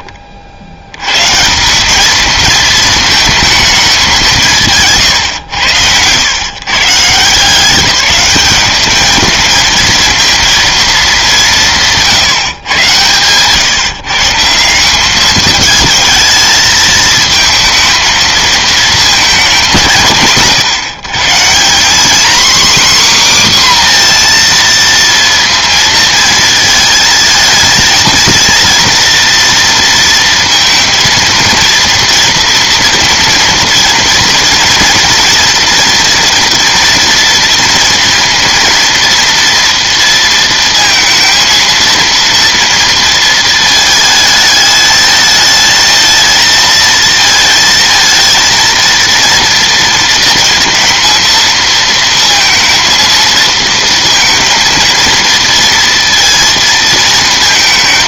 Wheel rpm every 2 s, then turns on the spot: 70, 220, 170, 130, 200, 230, 130, 180, 220, 230, 150, 260, 230, 220, 230, 230, 230, 230, 230, 230, 230, 230, 210, 230, 230, 230, 230, 230, 230.
none